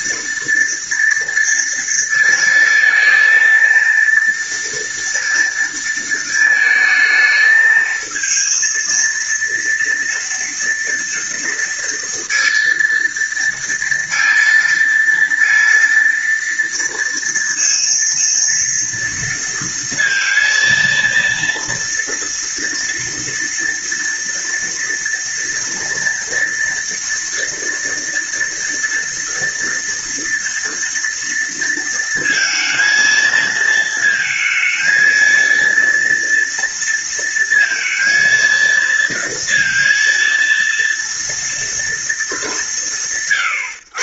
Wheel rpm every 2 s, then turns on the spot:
230, 230, 230, 220, 230, 230, 230, 230, 230, 230, 230, 230, 230, 230, 230, 230, 230, 220, 230, 230, 230, 170.
none